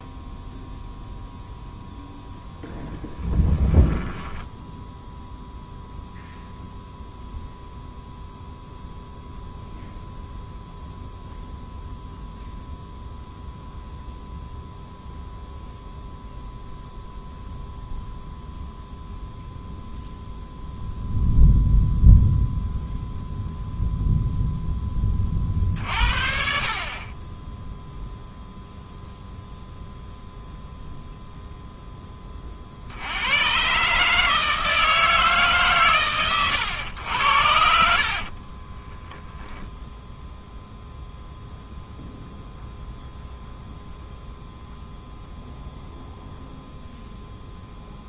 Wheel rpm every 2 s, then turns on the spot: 0, 0, 10, 0, 0, 0, 0, 0, 0, 0, 0, 0, 0, 40, 0, 0, 40, 160, 110, 40, 0, 0, 0, 0.
4-6 38-40